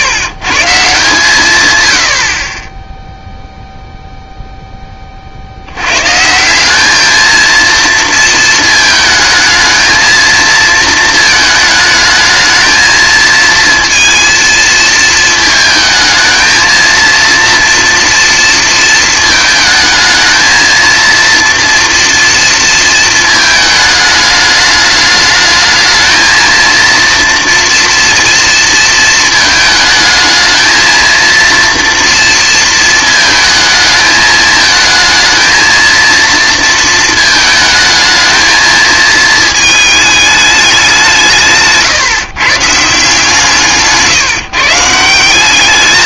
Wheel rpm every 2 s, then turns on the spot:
160, 20, 0, 180, 230, 230, 220, 230, 220, 230, 230, 230, 210, 230, 230, 220, 230, 220, 230, 220, 200, 140, 150.
none